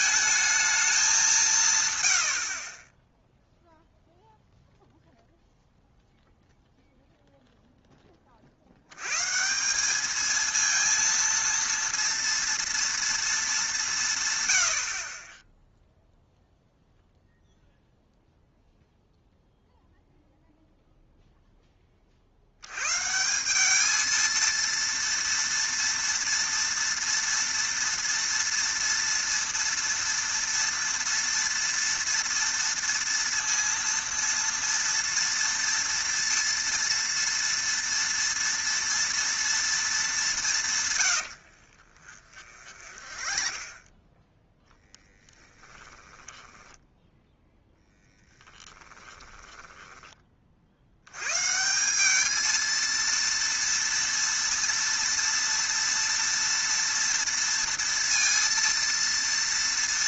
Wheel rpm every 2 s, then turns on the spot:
210, 40, 0, 0, 60, 230, 230, 90, 0, 0, 0, 80, 230, 230, 230, 230, 230, 230, 230, 230, 170, 40, 10, 10, 10, 60, 220, 230, 230, 230.
42-44 48-50